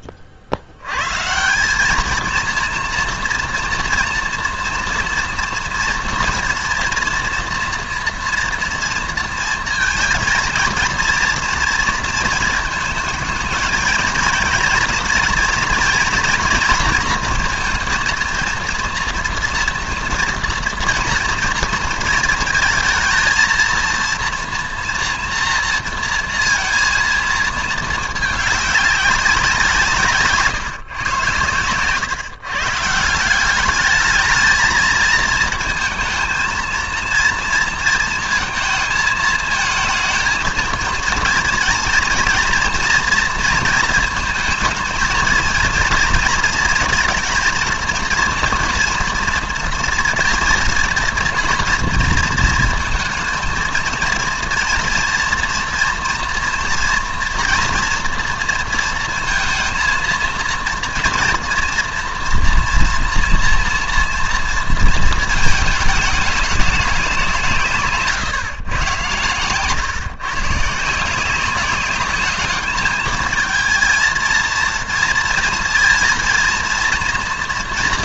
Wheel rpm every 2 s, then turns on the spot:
90, 230, 230, 230, 230, 230, 220, 230, 230, 230, 230, 220, 230, 230, 200, 140, 140, 220, 230, 220, 230, 240, 220, 230, 240, 230, 230, 230, 230, 230, 230, 230, 230, 200, 120, 160, 210, 230, 230.
none